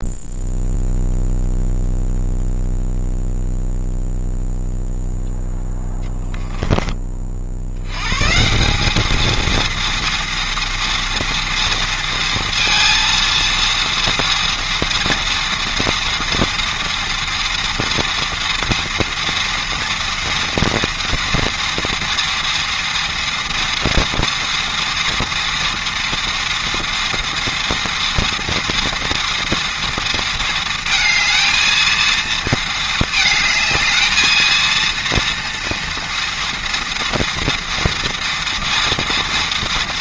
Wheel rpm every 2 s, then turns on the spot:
0, 0, 0, 10, 190, 230, 230, 230, 230, 230, 230, 230, 230, 240, 230, 230, 220, 230, 240, 230.
none